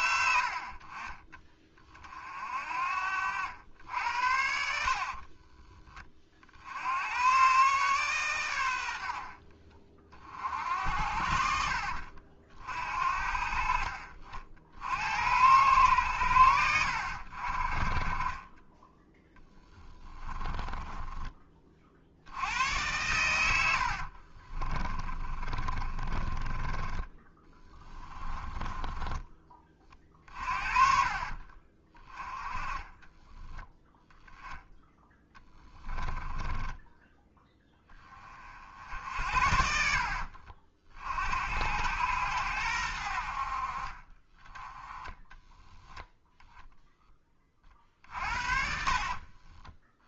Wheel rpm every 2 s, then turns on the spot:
50, 50, 60, 70, 90, 70, 60, 70, 80, 20, 20, 110, 30, 20, 20, 40, 20, 10, 10, 60, 50, 80, 10, 10, 50.
2-6 20-22 24-26 28-30 32-38 48-50